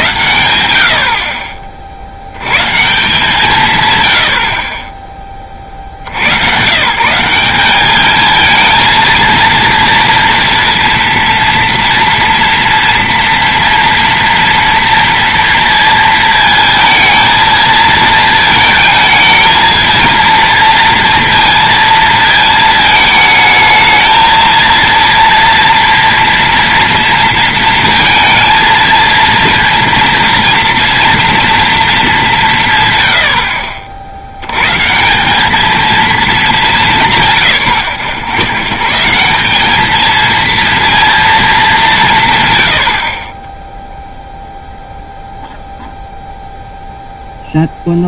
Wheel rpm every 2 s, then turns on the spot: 90, 130, 50, 130, 220, 230, 230, 230, 220, 220, 230, 220, 230, 230, 230, 240, 130, 110, 200, 120, 230, 100, 0, 0.
none